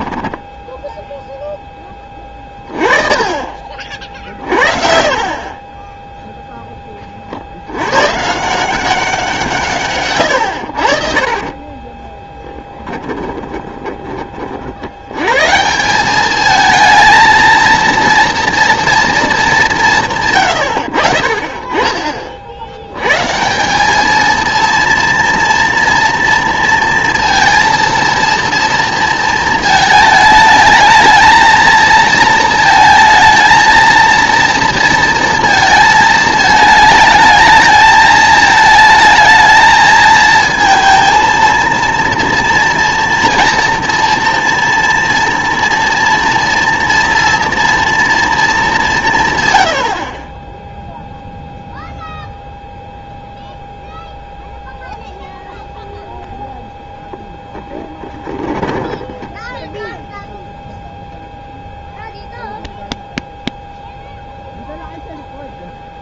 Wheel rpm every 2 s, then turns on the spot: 10, 30, 50, 10, 170, 80, 10, 60, 220, 230, 100, 80, 230, 230, 230, 220, 220, 230, 220, 220, 230, 230, 240, 230, 200, 10, 0, 0, 0, 10, 0, 0, 0.
0-2 10-14 58-60